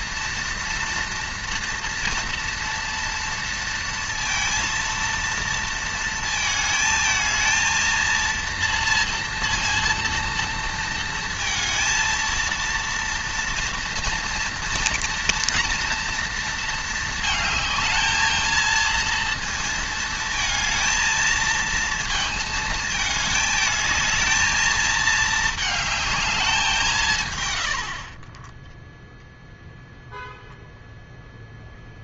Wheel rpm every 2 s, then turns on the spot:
230, 230, 230, 230, 230, 230, 230, 230, 220, 220, 220, 220, 220, 150, 0, 0.
none